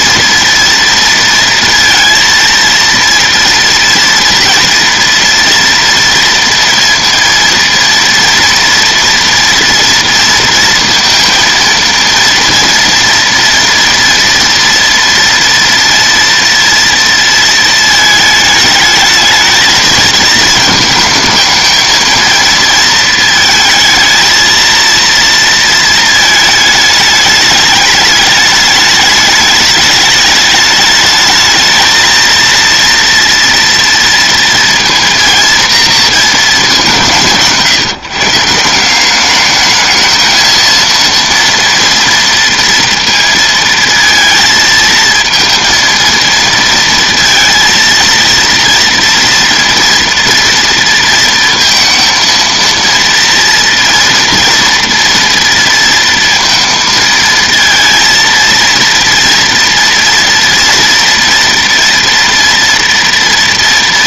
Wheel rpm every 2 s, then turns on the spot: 230, 230, 230, 230, 230, 230, 230, 230, 230, 220, 230, 230, 230, 210, 210, 210, 230, 230, 190, 170, 230, 230, 230, 230, 230, 230, 230, 230, 230, 230, 230, 230.
none